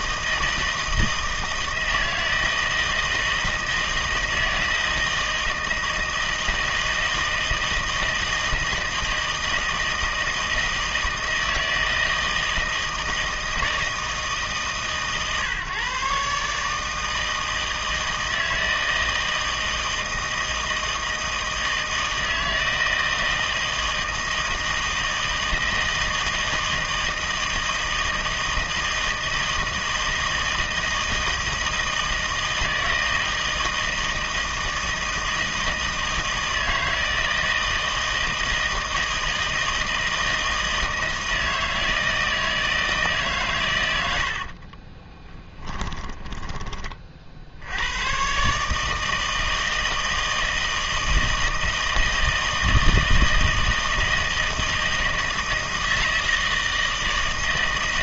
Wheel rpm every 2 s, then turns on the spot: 160, 160, 160, 160, 160, 160, 160, 150, 150, 160, 160, 160, 160, 160, 160, 160, 160, 160, 160, 160, 160, 160, 40, 30, 150, 160, 160, 160, 160.
44-46